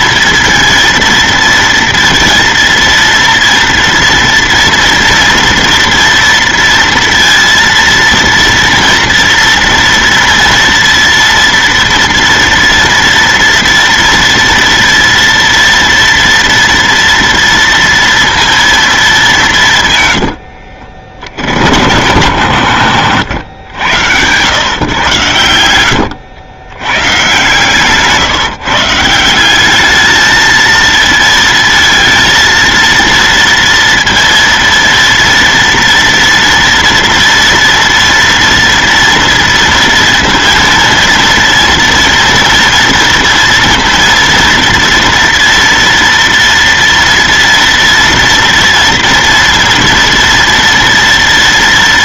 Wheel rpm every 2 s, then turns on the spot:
230, 230, 230, 230, 230, 230, 240, 230, 230, 230, 80, 90, 100, 100, 150, 220, 230, 230, 230, 230, 230, 240, 230, 230, 240, 230.
20-22